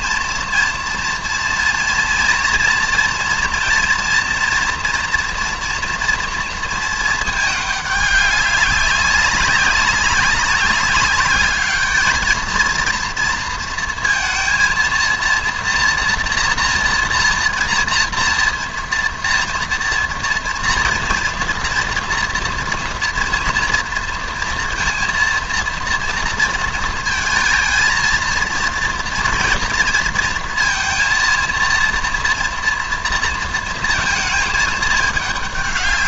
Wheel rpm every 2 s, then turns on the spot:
230, 240, 230, 230, 200, 200, 230, 230, 230, 230, 240, 230, 230, 230, 230, 230, 230, 220.
none